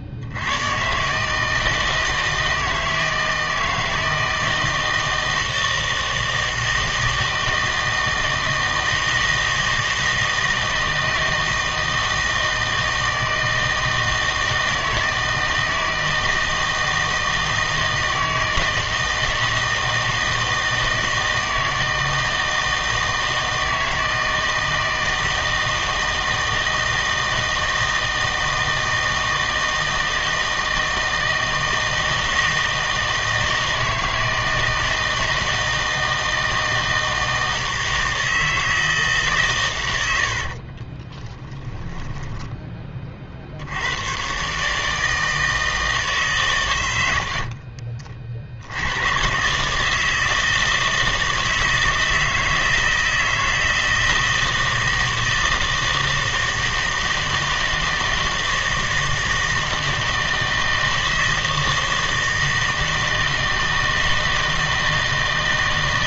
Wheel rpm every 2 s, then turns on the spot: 120, 160, 160, 160, 160, 160, 160, 160, 160, 160, 160, 160, 160, 160, 160, 160, 160, 160, 160, 160, 30, 20, 150, 100, 80, 160, 160, 160, 160, 160, 160, 160, 160.
40-42